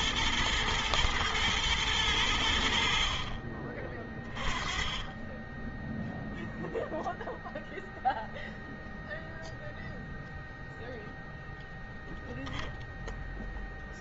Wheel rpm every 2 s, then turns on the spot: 120, 100, 30, 0, 0, 0, 0.
none